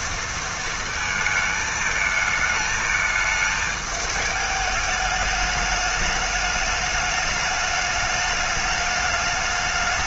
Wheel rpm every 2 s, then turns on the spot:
230, 220, 210, 210, 210.
none